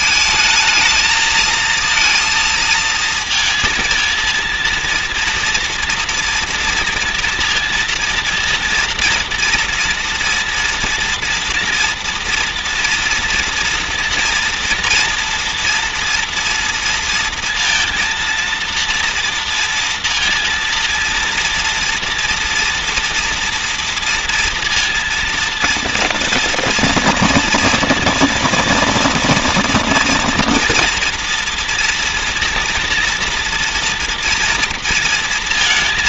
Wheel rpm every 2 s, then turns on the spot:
220, 230, 230, 230, 230, 230, 230, 230, 230, 230, 230, 240, 230, 230, 230, 230, 230, 230.
none